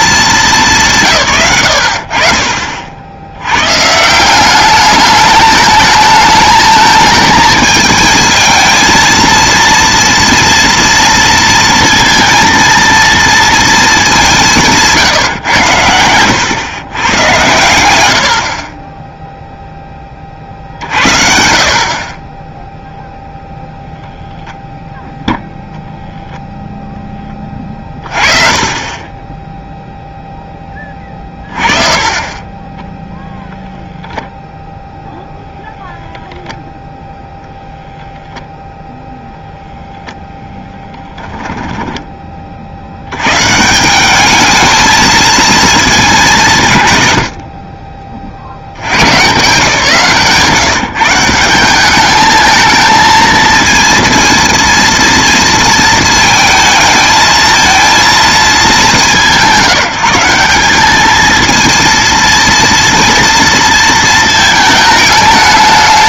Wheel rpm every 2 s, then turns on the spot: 190, 50, 200, 220, 220, 230, 230, 170, 110, 40, 50, 0, 0, 0, 30, 20, 10, 0, 0, 0, 10, 60, 220, 140, 70, 160, 220, 230, 220, 190, 200, 230, 220.
none